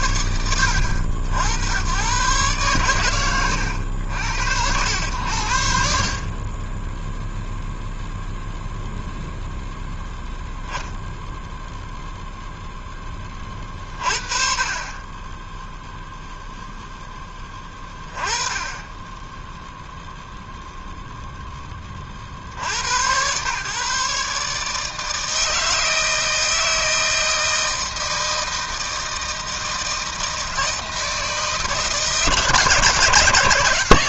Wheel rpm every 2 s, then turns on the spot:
80, 110, 70, 0, 0, 0, 20, 20, 10, 10, 0, 130, 160, 160, 160, 160, 150.
none